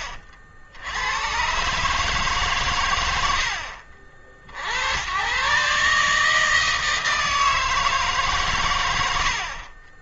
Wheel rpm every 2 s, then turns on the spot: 40, 130, 60, 150, 130.
none